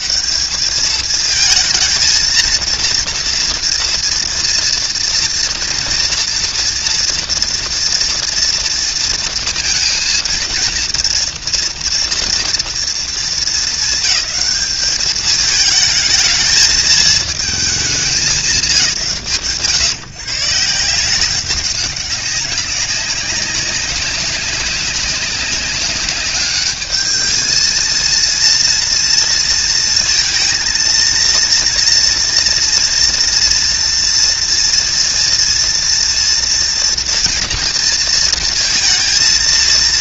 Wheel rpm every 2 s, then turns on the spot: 180, 230, 230, 240, 230, 230, 230, 200, 220, 150, 150, 190, 190, 210, 230, 230, 240, 230, 230, 230.
none